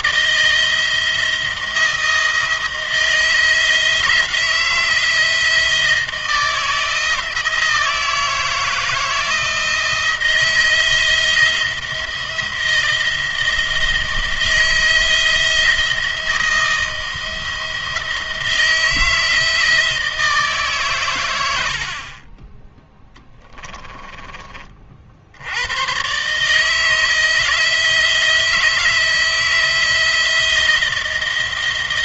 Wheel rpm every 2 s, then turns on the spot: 170, 160, 170, 160, 160, 170, 170, 170, 170, 160, 150, 20, 50, 150, 170, 170.
none